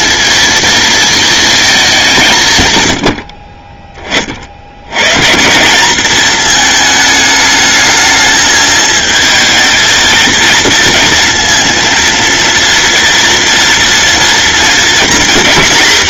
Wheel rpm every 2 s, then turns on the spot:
230, 110, 90, 220, 220, 220, 230, 230.
none